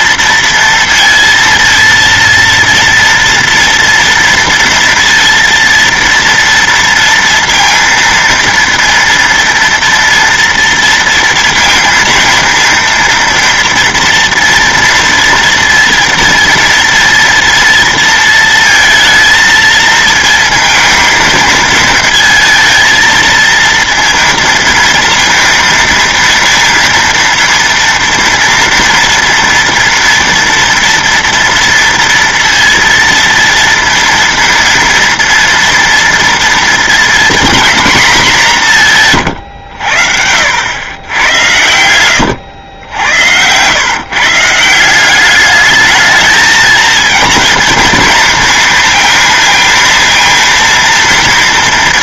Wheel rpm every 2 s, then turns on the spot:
230, 230, 230, 230, 230, 230, 230, 230, 230, 220, 230, 220, 230, 230, 230, 230, 230, 230, 230, 180, 90, 90, 160, 220, 220, 230.
none